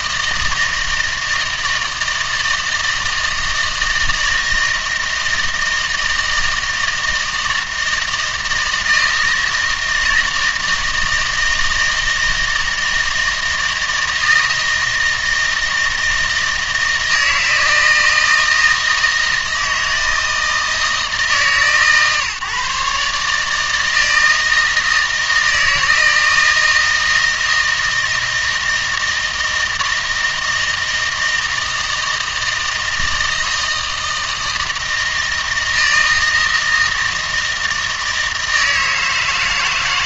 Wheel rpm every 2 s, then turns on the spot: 160, 160, 160, 160, 160, 160, 160, 160, 160, 160, 160, 140, 160, 160, 160, 160, 160, 160, 160, 160.
none